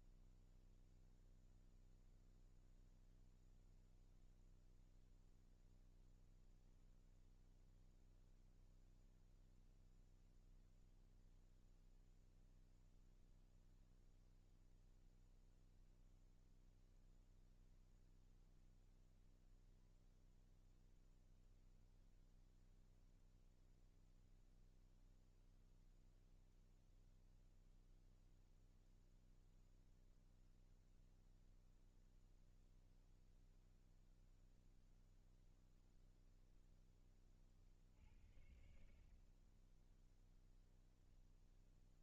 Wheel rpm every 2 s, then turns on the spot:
0, 0, 0, 0, 0, 0, 0, 0, 0, 0, 0, 0, 0, 0, 0, 0, 0, 0, 20, 40, 10.
38-40